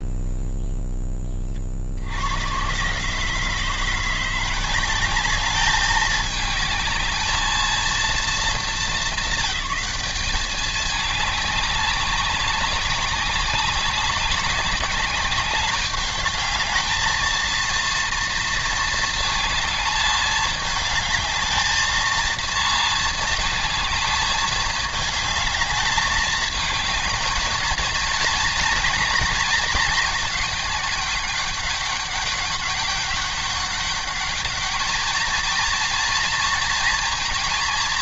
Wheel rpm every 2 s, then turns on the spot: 10, 130, 190, 210, 200, 210, 190, 200, 220, 220, 210, 230, 210, 220, 230, 210, 200, 220, 230.
none